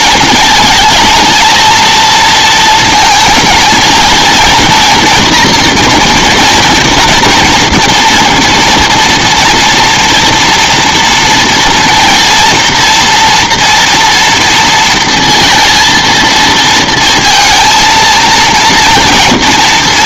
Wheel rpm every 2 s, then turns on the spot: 220, 220, 230, 230, 230, 240, 230, 230, 230, 230.
none